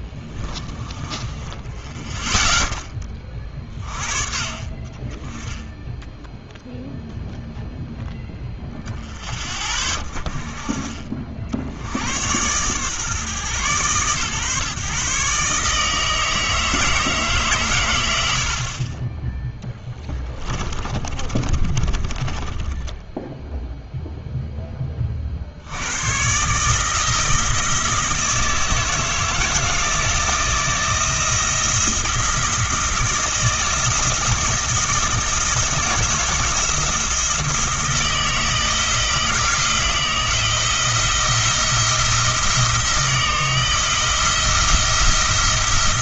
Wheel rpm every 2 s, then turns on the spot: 20, 0, 50, 0, 0, 40, 120, 140, 160, 40, 30, 10, 10, 150, 160, 170, 160, 170, 170, 160, 170, 160, 170.
0-2 20-24